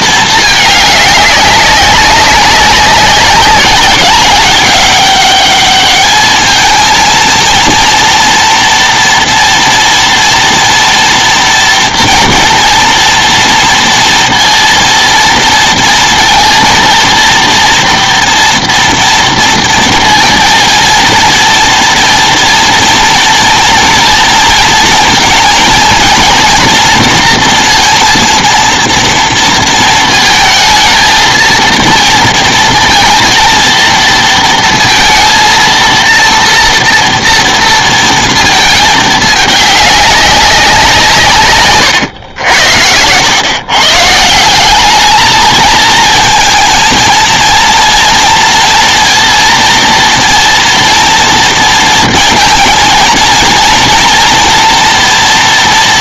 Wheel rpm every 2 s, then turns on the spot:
220, 190, 200, 220, 240, 240, 230, 230, 230, 230, 230, 240, 230, 230, 230, 220, 230, 230, 230, 230, 200, 100, 150, 220, 230, 230, 230, 230.
none